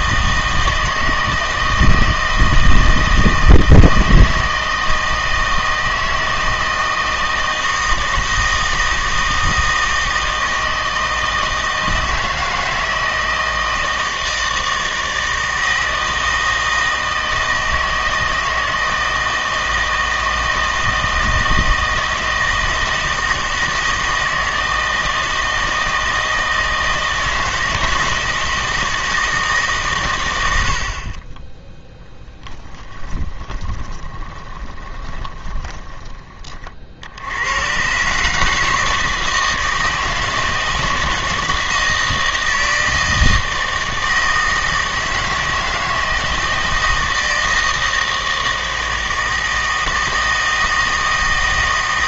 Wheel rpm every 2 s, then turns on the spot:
160, 160, 160, 160, 160, 160, 160, 160, 160, 160, 160, 160, 160, 160, 160, 80, 10, 20, 40, 160, 160, 160, 160, 160, 160, 160.
32-36